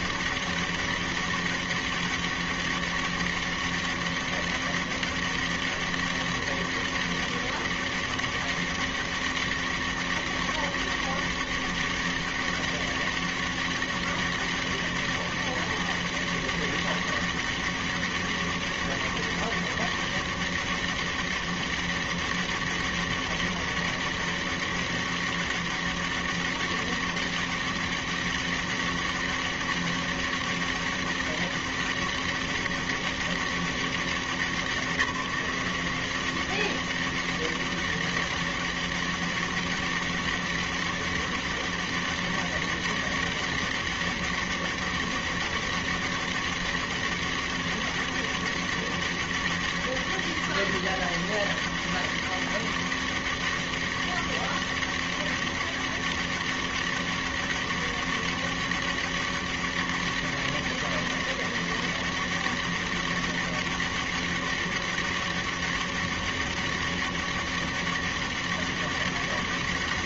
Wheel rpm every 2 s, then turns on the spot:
200, 200, 200, 200, 200, 200, 200, 200, 200, 200, 200, 200, 200, 200, 200, 200, 200, 170, 200, 200, 200, 200, 200, 200, 200, 200, 200, 200, 200, 200, 200, 200, 200, 200, 200.
none